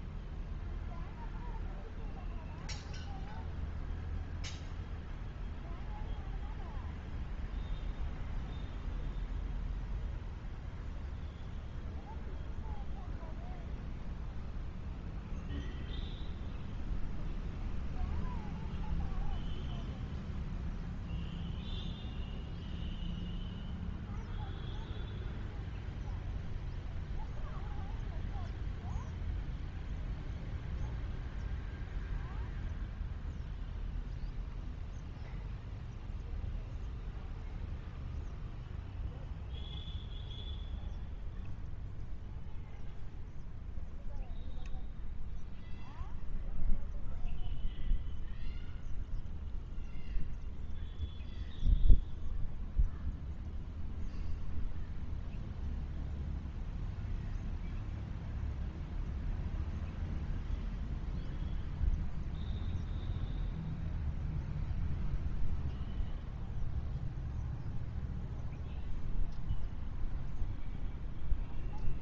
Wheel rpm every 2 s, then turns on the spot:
0, 0, 0, 0, 0, 0, 0, 0, 0, 0, 0, 0, 0, 0, 0, 0, 0, 0, 0, 0, 0, 0, 0, 0, 0, 0, 0, 0, 0, 0, 0, 0, 0, 0, 0, 0.
none